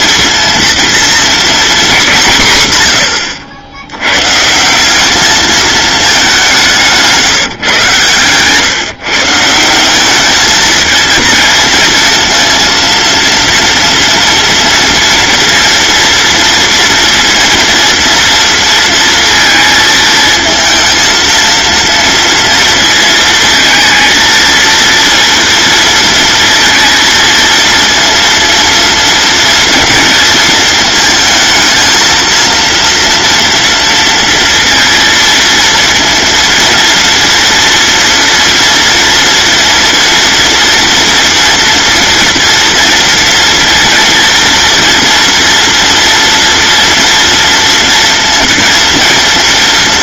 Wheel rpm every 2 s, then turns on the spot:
230, 140, 160, 180, 130, 220, 230, 230, 230, 230, 220, 230, 230, 230, 230, 220, 230, 230, 230, 230, 240, 230, 230, 230, 230.
none